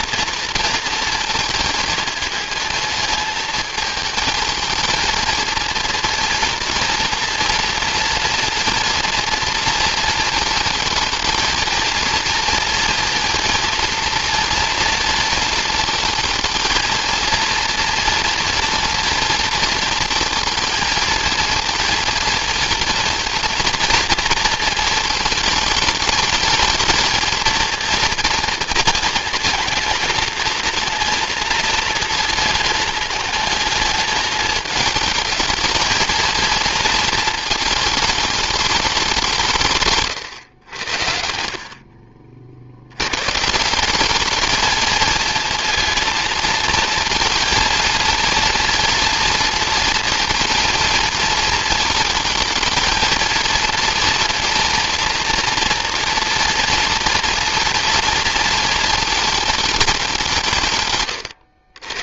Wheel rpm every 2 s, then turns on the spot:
230, 220, 220, 230, 230, 220, 230, 230, 220, 230, 230, 230, 230, 220, 230, 230, 220, 210, 230, 210, 90, 80, 220, 220, 230, 230, 220, 230, 230, 230, 130.
none